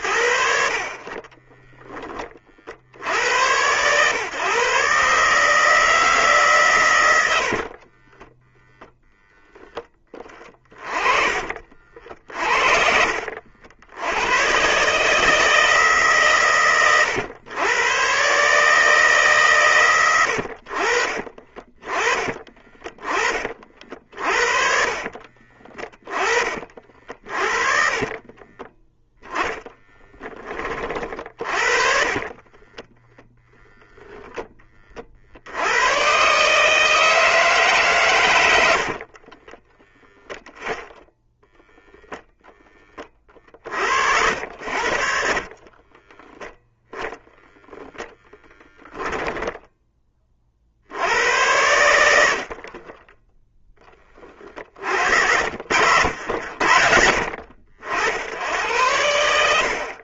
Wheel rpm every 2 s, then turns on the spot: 30, 70, 140, 110, 0, 20, 50, 140, 120, 150, 50, 30, 40, 40, 10, 30, 20, 30, 150, 70, 0, 30, 70, 0, 10, 60, 30, 50, 70, 90.
0-2 24-26 28-30 32-34 38-40 42-46 48-50 52-54